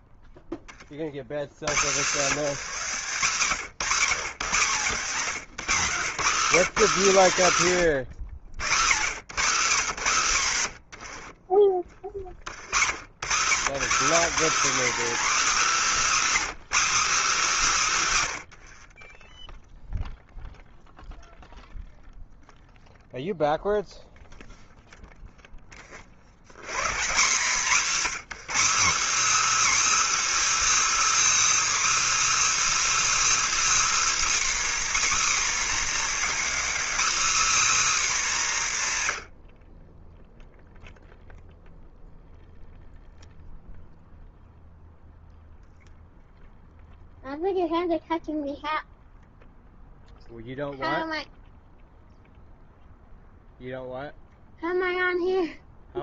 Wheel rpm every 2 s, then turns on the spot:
50, 210, 170, 230, 160, 110, 120, 310, 290, 60, 0, 0, 0, 150, 280, 350, 350, 290, 280, 150, 0, 0, 0, 0, 0, 0, 0, 0.
none